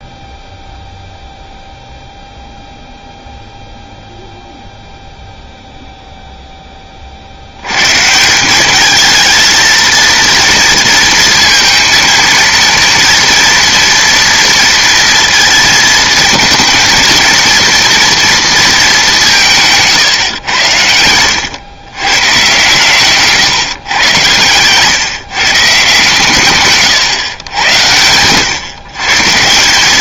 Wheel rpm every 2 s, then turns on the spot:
0, 0, 0, 20, 200, 230, 230, 230, 230, 220, 100, 130, 130, 140, 130.
20-22